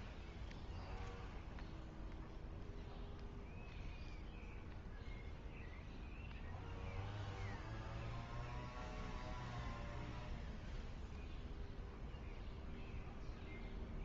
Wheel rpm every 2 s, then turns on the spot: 0, 0, 0, 0, 0, 0, 0.
none